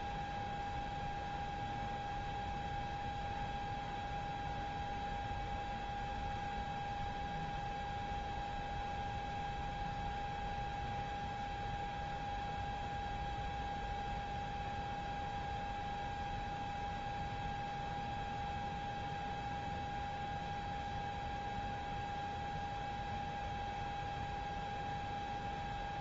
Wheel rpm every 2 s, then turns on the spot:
0, 0, 0, 0, 0, 0, 0, 0, 0, 0, 0, 0, 0.
none